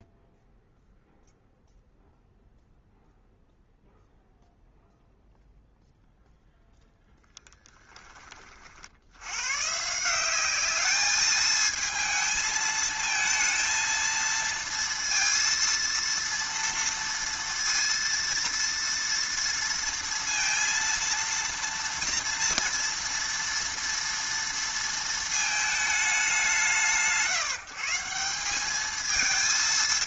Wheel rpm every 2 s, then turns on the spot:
0, 0, 0, 0, 50, 200, 220, 230, 230, 230, 230, 230, 230, 170, 190.
none